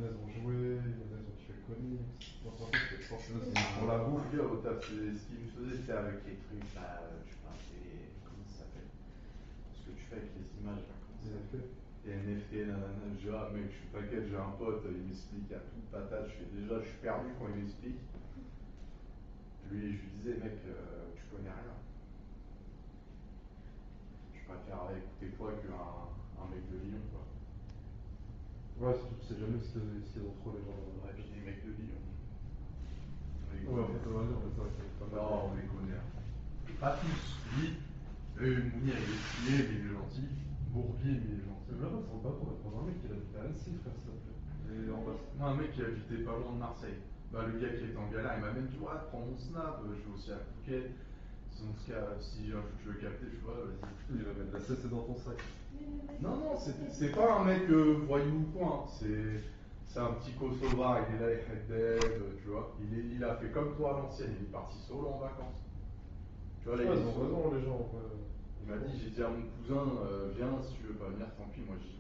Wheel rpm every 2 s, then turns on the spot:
0, 0, 0, 0, 0, 0, 0, 0, 0, 0, 0, 0, 0, 0, 0, 0, 0, 0, 0, 0, 0, 0, 0, 0, 0, 0, 0, 0, 0, 0, 0, 0, 0, 0, 0, 0.
none